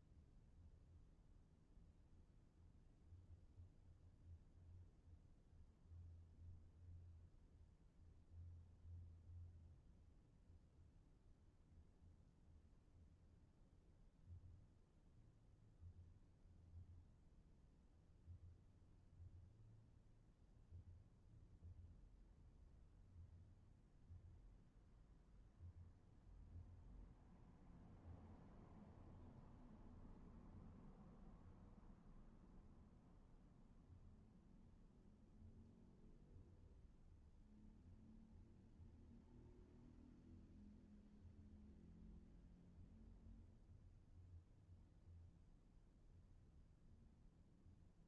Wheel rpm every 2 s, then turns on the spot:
0, 0, 0, 0, 0, 0, 0, 0, 0, 0, 0, 0, 0, 0, 0, 0, 0, 0, 0, 0, 0, 0, 0, 0.
none